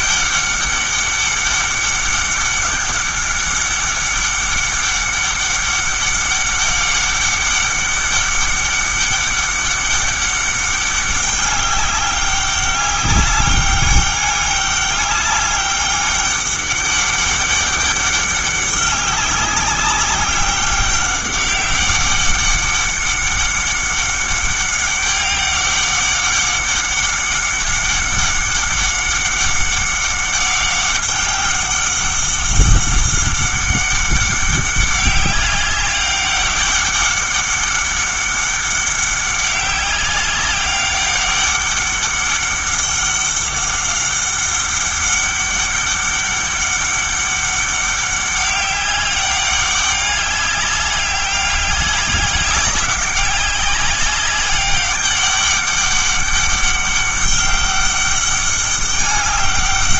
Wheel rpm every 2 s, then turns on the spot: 200, 200, 200, 200, 200, 200, 200, 200, 200, 200, 190, 200, 200, 190, 200, 190, 190, 190, 200, 200, 190, 200, 200, 200, 200, 200, 200, 200, 200, 200.
none